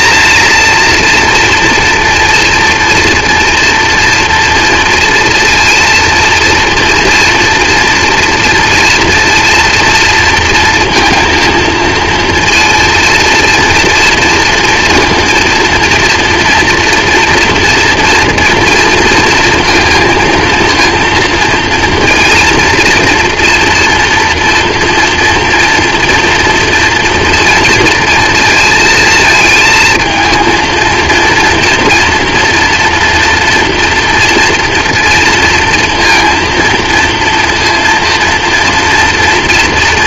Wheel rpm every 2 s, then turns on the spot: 230, 240, 240, 230, 240, 230, 230, 230, 230, 230, 230, 230, 230, 230, 230, 230, 240, 230, 230, 230.
none